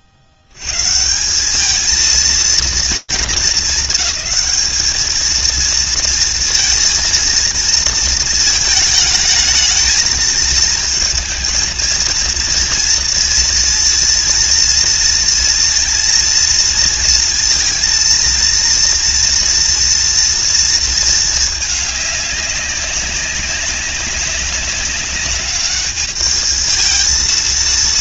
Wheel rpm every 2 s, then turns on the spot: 80, 230, 220, 230, 220, 220, 230, 230, 230, 230, 230, 200, 200, 220.
none